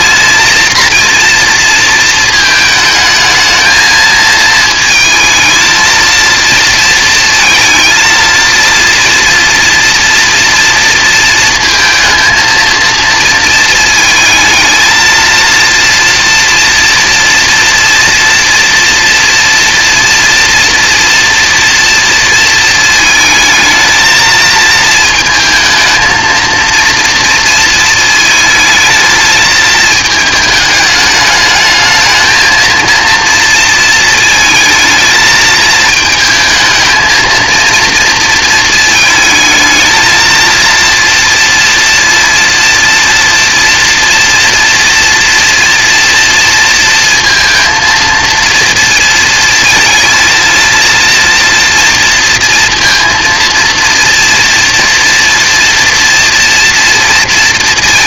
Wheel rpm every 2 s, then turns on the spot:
230, 220, 220, 230, 230, 230, 230, 220, 230, 230, 230, 230, 220, 230, 220, 210, 220, 220, 220, 230, 230, 230, 230, 230, 230, 230, 230, 230, 230.
none